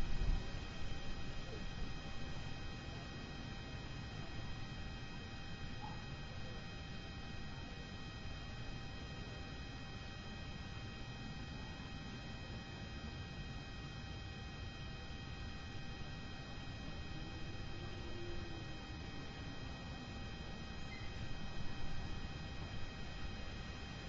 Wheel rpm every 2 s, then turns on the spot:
0, 0, 0, 0, 0, 0, 0, 0, 0, 0, 0, 0.
none